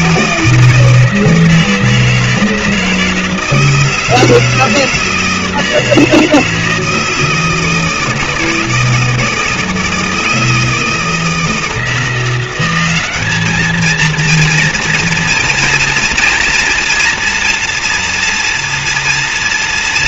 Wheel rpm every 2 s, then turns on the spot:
160, 160, 160, 160, 160, 160, 180, 230, 230, 230.
none